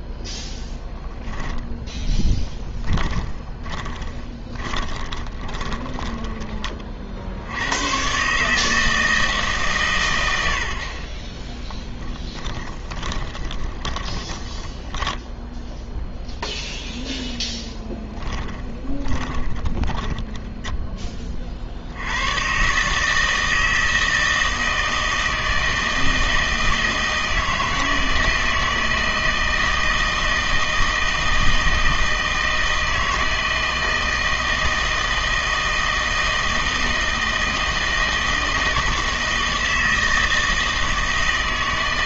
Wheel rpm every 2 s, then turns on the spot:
10, 10, 20, 30, 150, 70, 10, 10, 0, 10, 0, 130, 160, 160, 160, 160, 160, 160, 160, 160, 160.
2-6 12-16 18-20